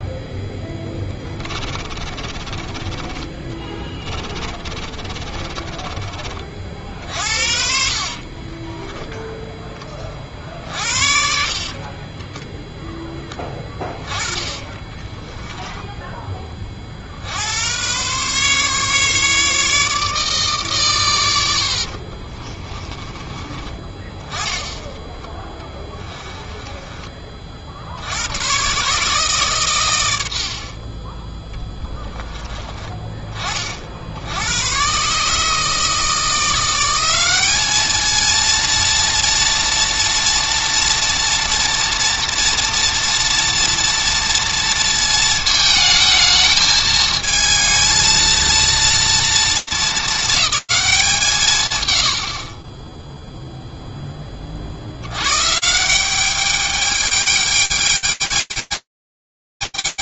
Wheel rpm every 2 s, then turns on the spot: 10, 20, 20, 50, 20, 50, 10, 30, 20, 140, 140, 30, 10, 10, 120, 60, 20, 100, 170, 230, 230, 240, 230, 220, 230, 210, 30, 70, 210, 210.
2-6 8-10 14-16 22-24 26-28